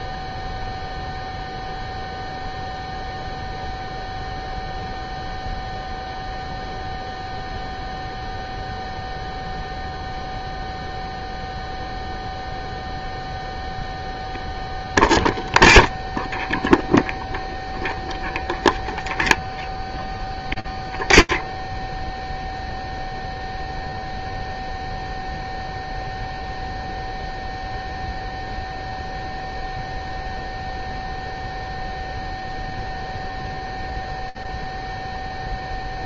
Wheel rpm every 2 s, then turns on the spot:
0, 0, 0, 0, 0, 0, 0, 0, 0, 0, 0, 0, 0, 0, 0, 0, 0, 0.
none